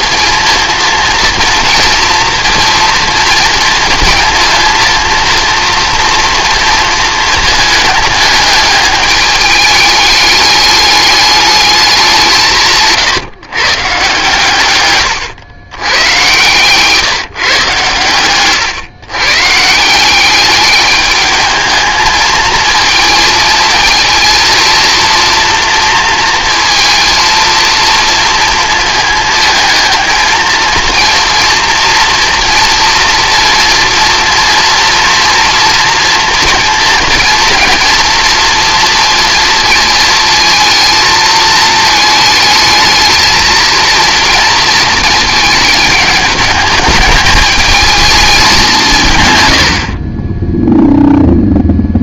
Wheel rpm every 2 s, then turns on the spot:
230, 230, 230, 230, 210, 210, 160, 120, 130, 120, 200, 230, 230, 230, 230, 230, 230, 230, 230, 230, 220, 220, 230, 220, 200, 10.
18-20